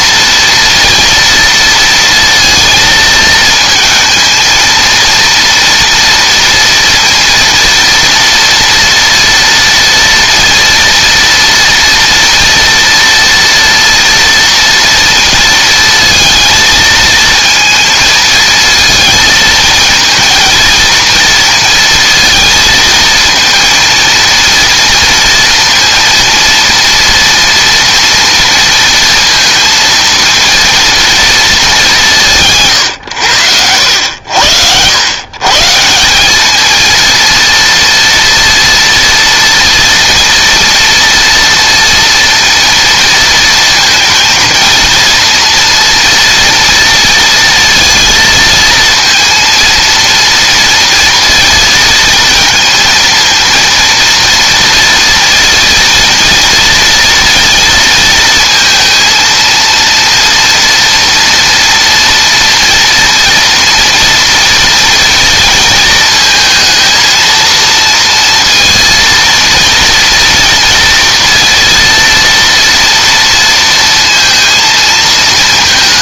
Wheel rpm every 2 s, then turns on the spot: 230, 230, 230, 230, 230, 230, 230, 230, 230, 220, 230, 220, 230, 230, 230, 230, 140, 90, 210, 240, 230, 230, 230, 230, 230, 230, 230, 230, 230, 230, 230, 230, 230, 230, 230, 240, 230, 230.
none